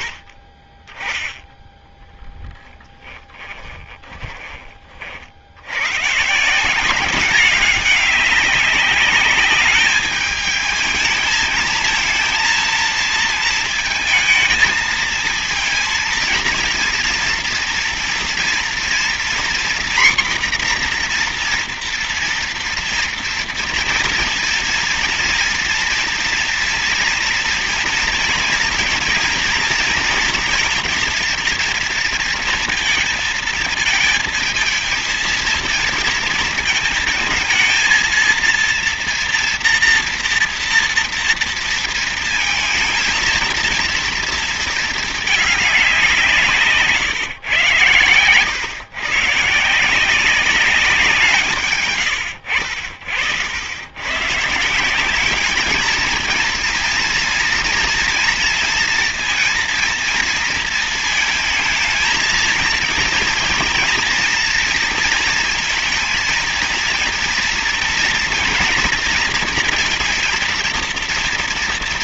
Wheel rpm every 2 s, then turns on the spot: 30, 20, 30, 160, 200, 220, 230, 220, 230, 240, 250, 230, 230, 240, 230, 220, 230, 220, 230, 230, 230, 230, 220, 160, 110, 190, 70, 150, 220, 230, 230, 230, 230, 230, 240, 230.
2-4